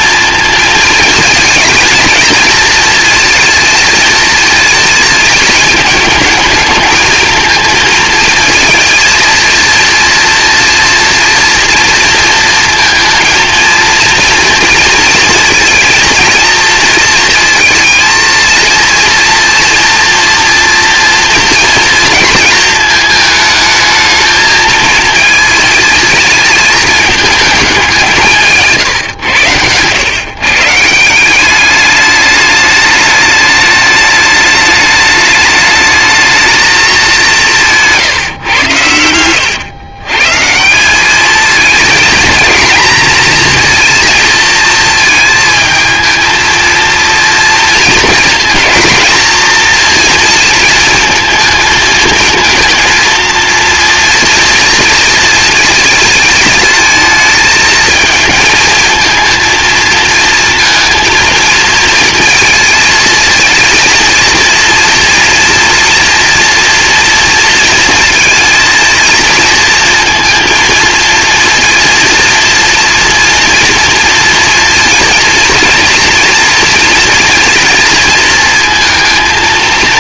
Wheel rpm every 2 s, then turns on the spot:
230, 230, 230, 220, 230, 230, 230, 230, 230, 230, 230, 220, 220, 220, 160, 150, 210, 210, 220, 120, 170, 240, 230, 230, 230, 230, 230, 230, 220, 230, 230, 220, 230, 230, 230, 230, 230, 230, 230, 230.
none